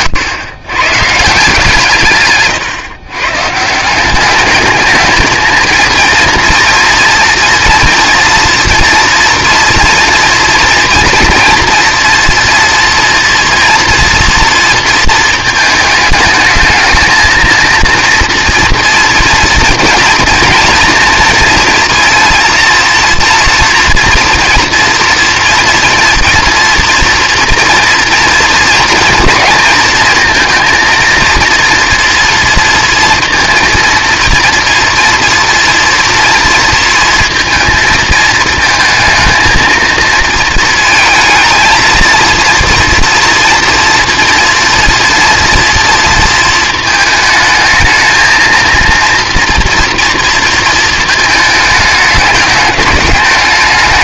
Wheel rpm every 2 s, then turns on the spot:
120, 140, 210, 240, 230, 230, 230, 230, 220, 230, 230, 230, 240, 240, 230, 230, 230, 240, 230, 220, 230, 230, 240, 230, 230, 220, 210.
none